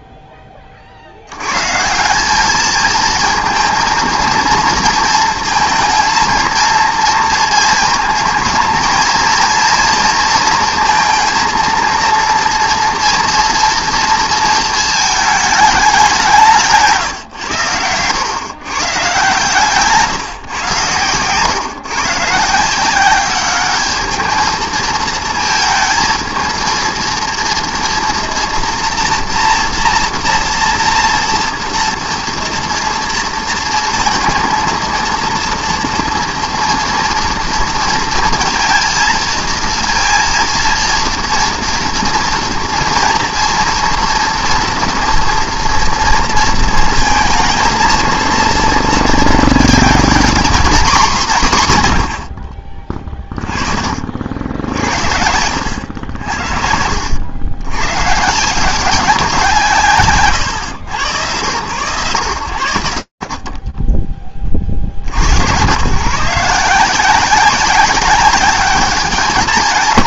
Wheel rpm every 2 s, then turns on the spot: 30, 220, 230, 230, 220, 230, 230, 230, 170, 130, 120, 160, 220, 230, 240, 230, 230, 230, 230, 230, 230, 230, 240, 230, 230, 240, 50, 70, 80, 180, 100, 50, 80, 180, 180.
52-58